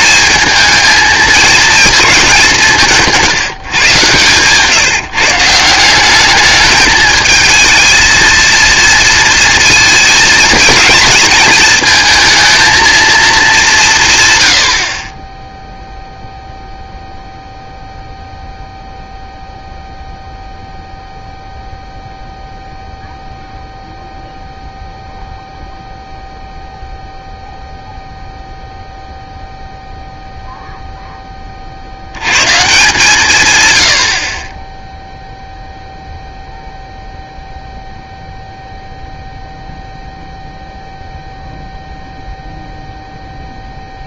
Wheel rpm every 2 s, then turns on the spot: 220, 180, 140, 220, 230, 220, 230, 50, 0, 0, 0, 0, 0, 0, 0, 0, 140, 10, 0, 0, 0, 0.
none